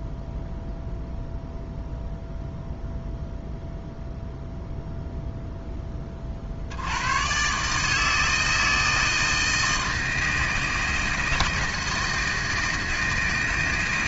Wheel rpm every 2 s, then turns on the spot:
0, 0, 0, 70, 160, 160, 160.
none